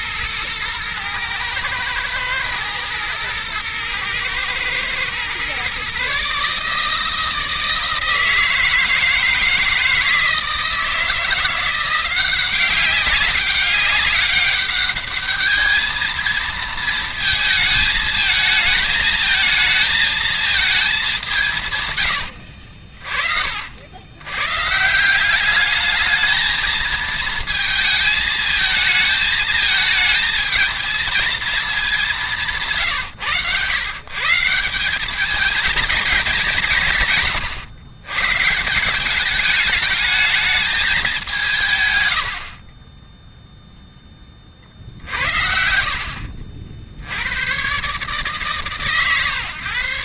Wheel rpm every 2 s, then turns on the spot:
110, 120, 120, 150, 160, 160, 190, 200, 220, 220, 210, 70, 150, 220, 220, 220, 140, 180, 160, 170, 200, 20, 50, 70, 150.
32-34 42-44